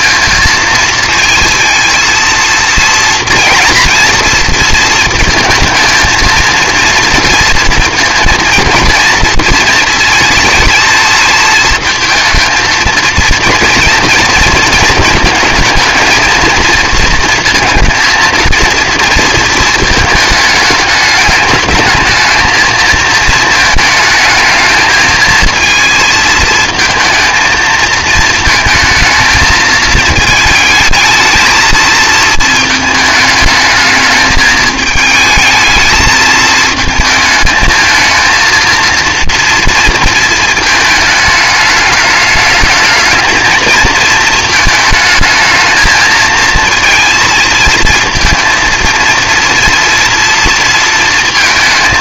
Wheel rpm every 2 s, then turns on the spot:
220, 230, 230, 230, 230, 230, 230, 220, 230, 230, 210, 220, 220, 230, 230, 220, 220, 220, 220, 230, 220, 220, 220, 230, 230, 230.
none